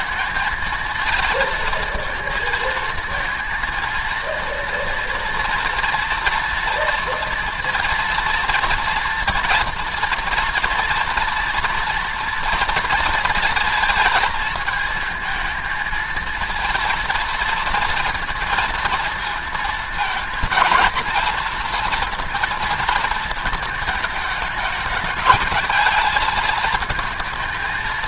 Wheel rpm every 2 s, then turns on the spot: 230, 230, 230, 230, 230, 240, 230, 220, 230, 230, 230, 230, 210, 220.
none